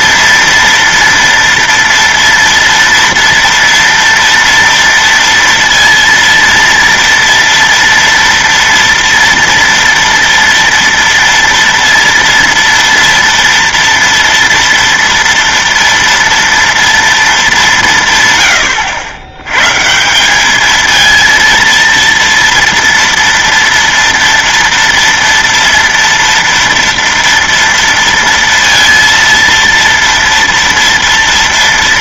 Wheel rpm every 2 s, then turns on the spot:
230, 230, 230, 230, 230, 230, 230, 230, 230, 110, 210, 230, 230, 240, 230, 230.
none